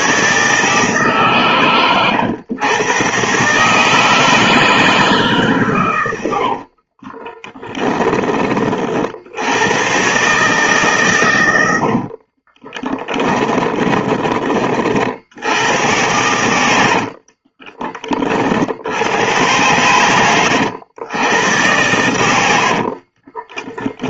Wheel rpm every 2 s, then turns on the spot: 150, 130, 160, 30, 70, 130, 20, 70, 60, 80, 100, 40.
6-8 12-14 16-18 22-24